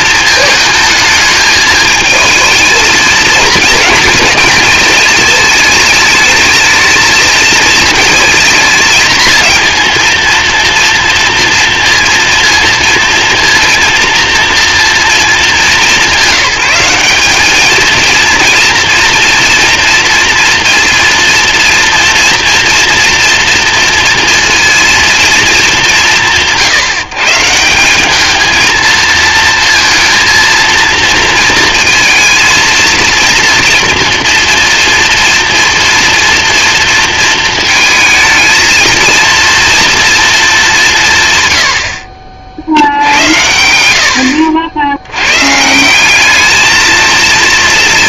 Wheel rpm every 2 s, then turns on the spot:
220, 220, 220, 220, 220, 230, 230, 230, 190, 230, 230, 230, 230, 170, 230, 230, 230, 230, 230, 230, 180, 70, 90, 220.
none